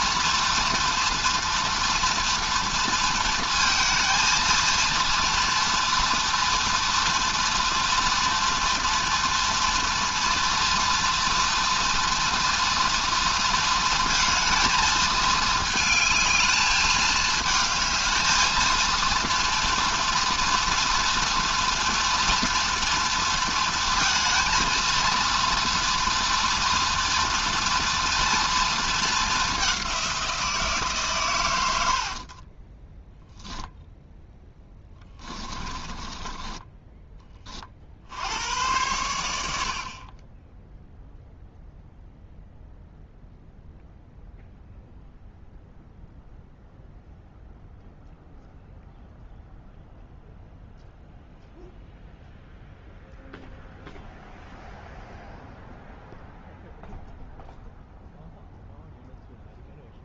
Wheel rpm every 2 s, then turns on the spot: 230, 230, 230, 230, 230, 230, 240, 220, 220, 230, 240, 230, 230, 230, 220, 150, 10, 10, 10, 100, 0, 0, 0, 0, 0, 0, 0, 0, 0, 0.
32-36